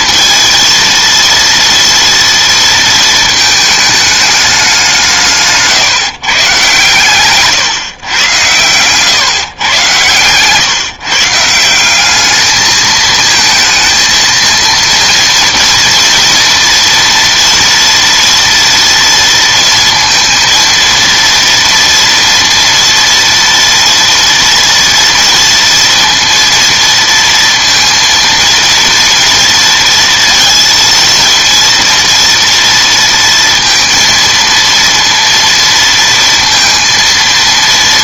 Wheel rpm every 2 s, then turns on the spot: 230, 230, 200, 140, 110, 130, 210, 220, 230, 230, 230, 230, 230, 230, 230, 230, 230, 230, 230.
none